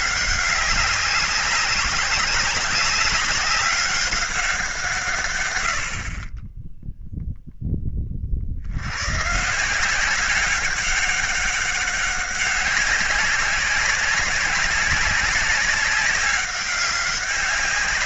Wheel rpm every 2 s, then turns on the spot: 200, 190, 170, 10, 80, 190, 200, 200, 200.
none